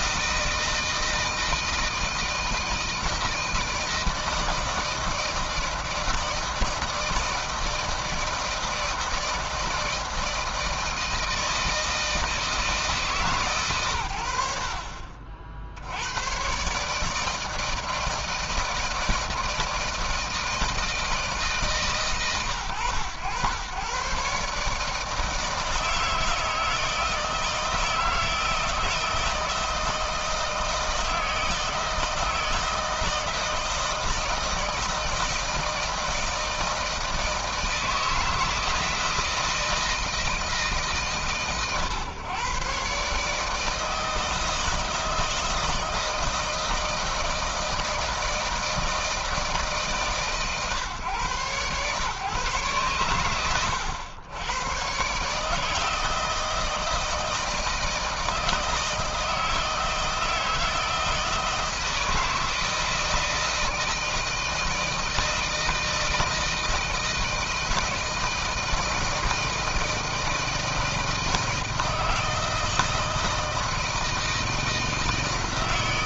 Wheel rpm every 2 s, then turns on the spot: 160, 160, 160, 160, 160, 160, 160, 80, 120, 160, 160, 130, 140, 160, 160, 160, 160, 160, 160, 160, 160, 120, 160, 160, 160, 140, 140, 120, 160, 160, 160, 160, 160, 160, 160, 160, 160, 160.
none